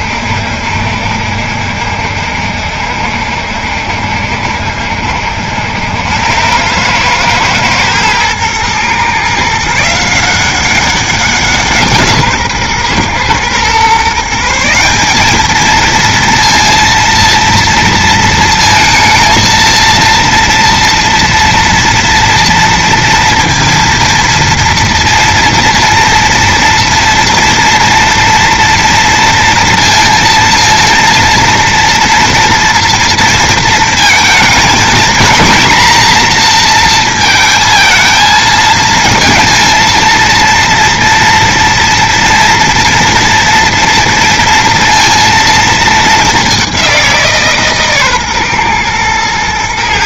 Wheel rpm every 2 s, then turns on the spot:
70, 70, 70, 100, 120, 180, 130, 180, 230, 220, 230, 230, 230, 230, 230, 230, 230, 220, 230, 220, 230, 230, 230, 190, 120.
none